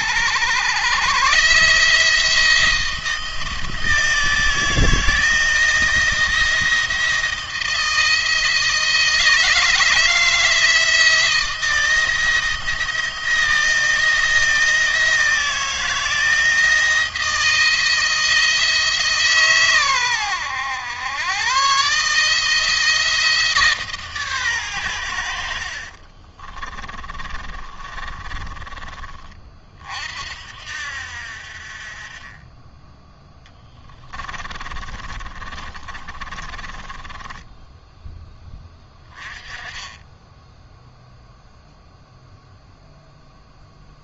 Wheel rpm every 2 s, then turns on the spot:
120, 160, 160, 170, 160, 160, 160, 160, 160, 160, 100, 160, 110, 20, 30, 60, 20, 30, 20, 10, 0, 0.
26-28 34-36